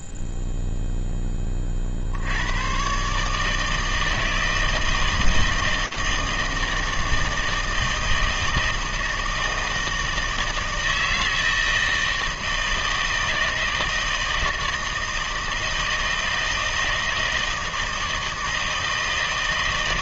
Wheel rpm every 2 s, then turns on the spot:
0, 40, 160, 160, 160, 160, 160, 160, 160, 160.
none